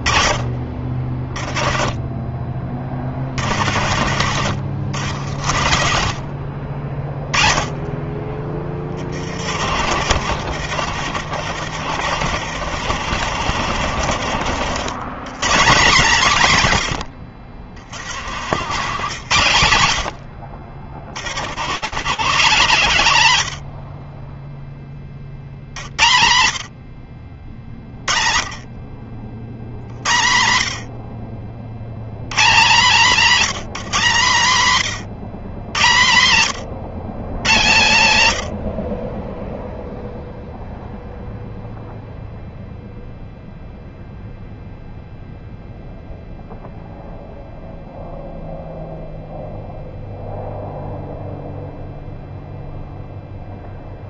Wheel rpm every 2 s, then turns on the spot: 20, 30, 90, 50, 20, 90, 90, 90, 170, 100, 80, 200, 20, 60, 50, 80, 180, 140, 130, 60, 0, 0, 0, 0, 0, 0, 0.
2-4